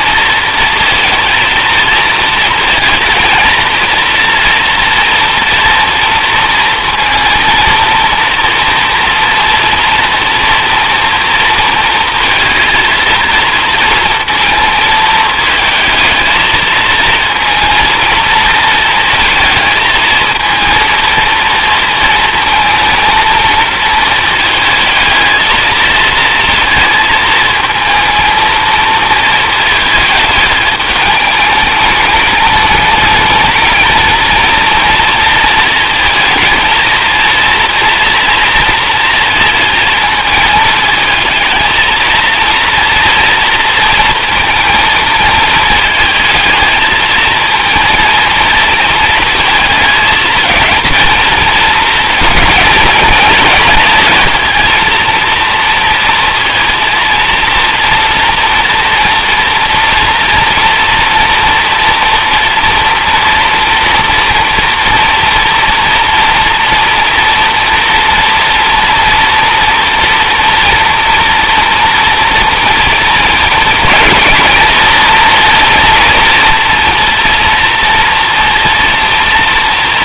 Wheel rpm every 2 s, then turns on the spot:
230, 230, 230, 230, 230, 240, 220, 230, 220, 230, 230, 230, 220, 230, 220, 210, 210, 230, 230, 230, 220, 230, 220, 220, 220, 220, 220, 230, 230, 230, 230, 240, 230, 230, 230, 230, 230, 230, 230, 230.
none